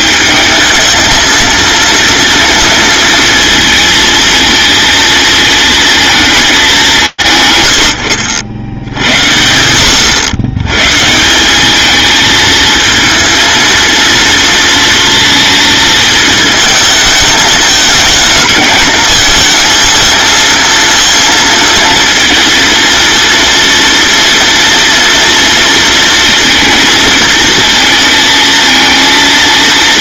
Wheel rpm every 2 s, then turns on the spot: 220, 230, 230, 160, 90, 130, 230, 230, 220, 220, 230, 230, 230, 230, 230.
none